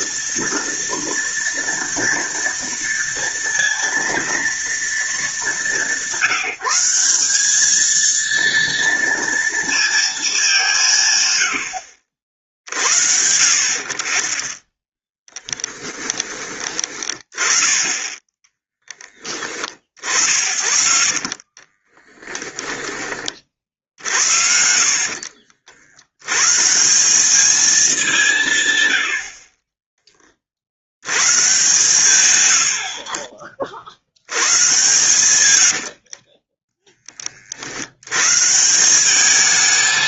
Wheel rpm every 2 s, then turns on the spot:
230, 230, 220, 190, 230, 160, 60, 10, 20, 10, 50, 20, 50, 180, 100, 90, 60, 120, 20, 180.
14-16 20-22